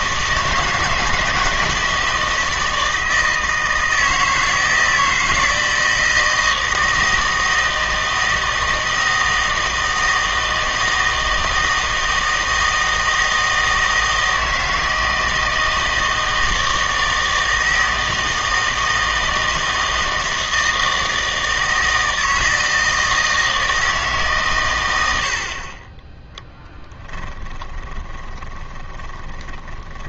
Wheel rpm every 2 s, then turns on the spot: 160, 160, 160, 160, 160, 160, 160, 160, 160, 160, 160, 160, 110, 10, 20.
26-30